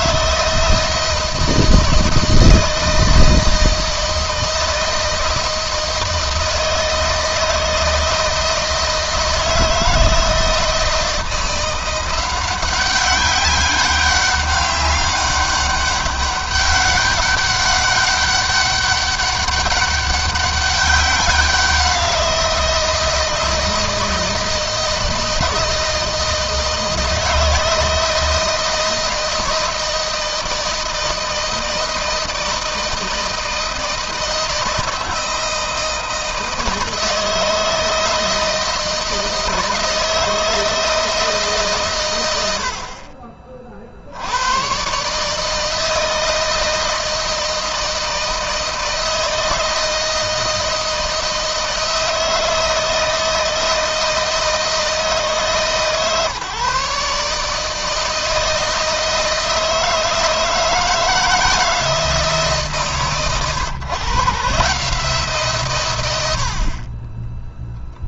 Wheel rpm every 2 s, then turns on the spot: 160, 160, 160, 160, 160, 170, 190, 200, 200, 200, 190, 160, 160, 160, 160, 160, 160, 160, 160, 160, 160, 50, 130, 160, 160, 160, 160, 150, 140, 160, 160, 130, 150, 30.
none